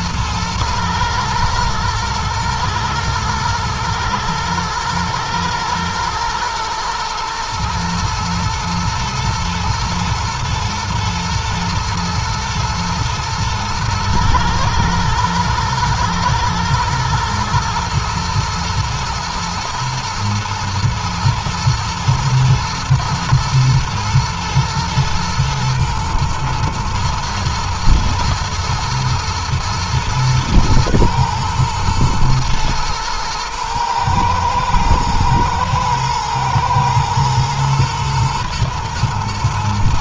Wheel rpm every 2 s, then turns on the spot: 120, 120, 110, 110, 120, 120, 120, 110, 110, 110, 110, 120, 110, 120, 120, 110, 110, 120, 110, 120.
none